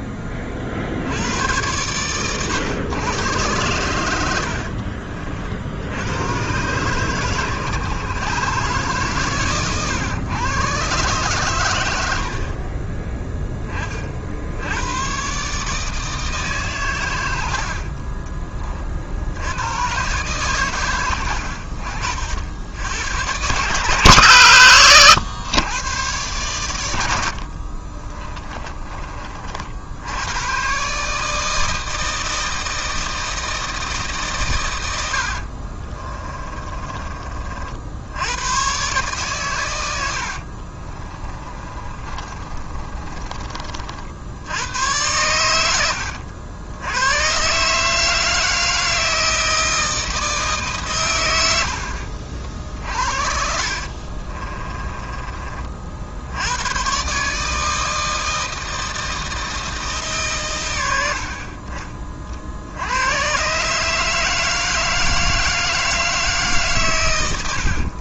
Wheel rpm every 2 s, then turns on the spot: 60, 120, 50, 120, 140, 120, 20, 90, 130, 40, 120, 90, 120, 90, 30, 140, 160, 100, 30, 120, 30, 30, 100, 90, 160, 140, 60, 20, 110, 160, 90, 80, 160, 140.
4-6 40-44 52-56